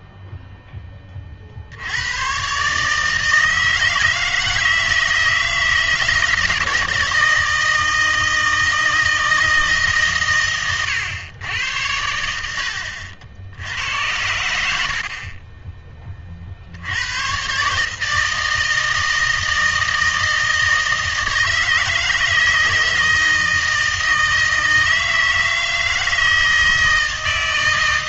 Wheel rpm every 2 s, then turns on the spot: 10, 140, 160, 160, 160, 120, 70, 60, 80, 160, 160, 160, 160, 160.
12-14